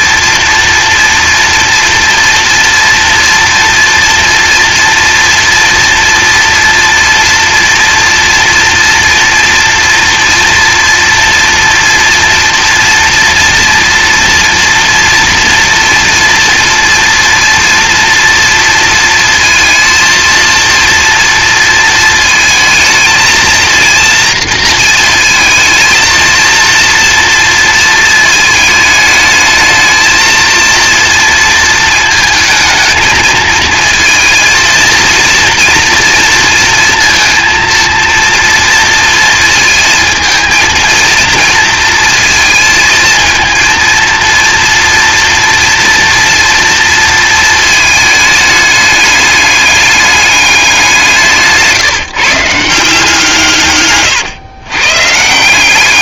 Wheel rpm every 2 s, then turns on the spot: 230, 230, 240, 230, 240, 240, 230, 230, 230, 230, 230, 220, 230, 230, 220, 230, 220, 230, 230, 230, 220, 230, 230, 230, 210, 200, 160, 120.
none